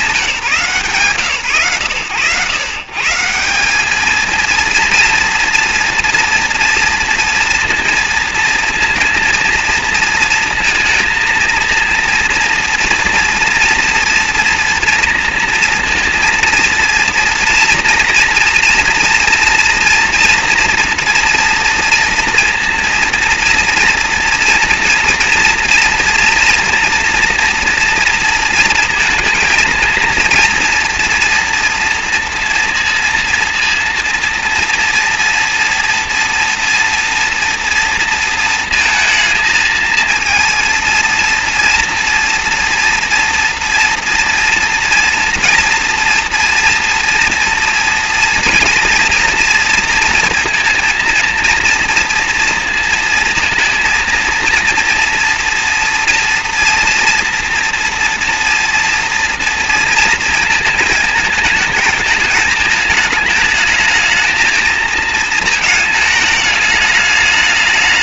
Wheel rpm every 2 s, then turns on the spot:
140, 150, 230, 240, 230, 230, 230, 230, 230, 230, 230, 240, 230, 230, 230, 230, 230, 230, 230, 230, 230, 230, 230, 230, 230, 230, 230, 240, 240, 240, 220, 220, 220, 210.
none